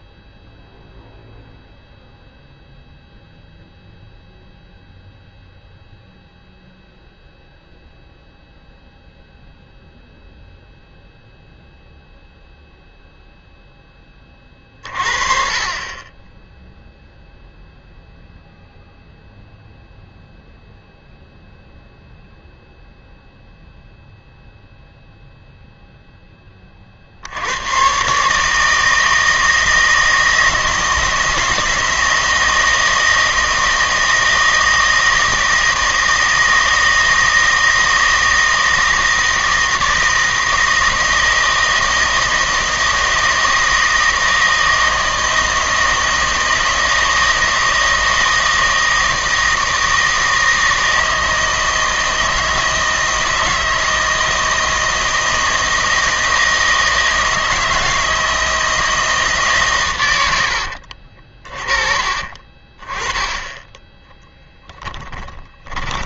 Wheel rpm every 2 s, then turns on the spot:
0, 0, 0, 0, 0, 0, 0, 30, 0, 0, 0, 0, 0, 30, 160, 160, 160, 160, 160, 160, 160, 160, 160, 160, 160, 160, 160, 160, 160, 160, 70, 30, 10.
60-62